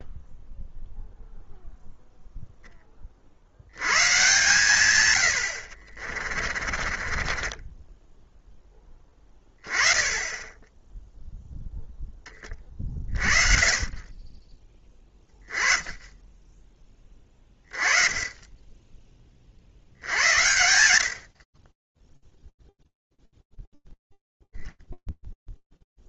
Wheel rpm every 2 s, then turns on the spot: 0, 20, 100, 30, 20, 0, 30, 10, 10, 20, 50, 0, 0.
6-8